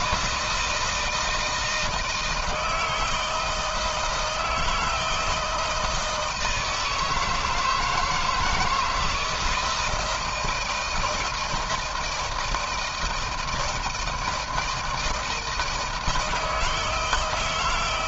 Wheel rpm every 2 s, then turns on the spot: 160, 160, 160, 160, 160, 160, 160, 170, 160.
none